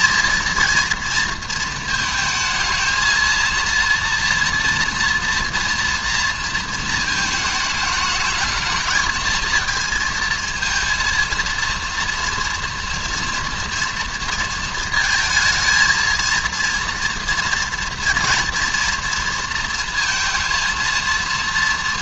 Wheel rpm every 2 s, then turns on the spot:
230, 220, 230, 230, 210, 230, 230, 230, 230, 240, 230.
none